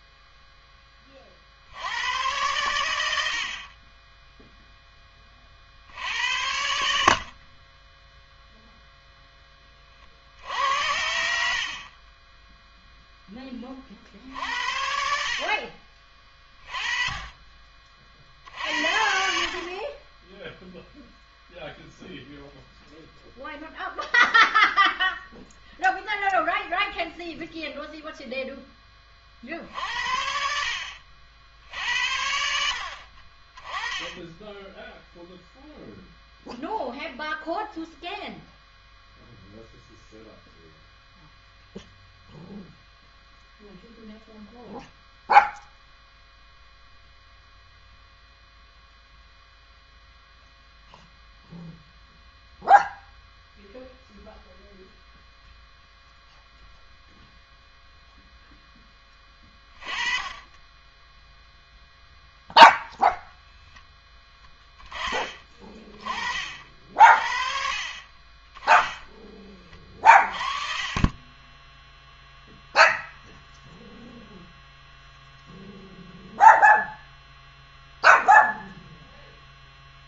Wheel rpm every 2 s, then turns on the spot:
20, 110, 10, 70, 0, 80, 0, 80, 40, 70, 0, 0, 0, 0, 20, 60, 60, 10, 0, 0, 0, 0, 0, 0, 0, 0, 0, 0, 0, 10, 10, 0, 20, 60, 10, 30, 0, 0, 0, 0.
none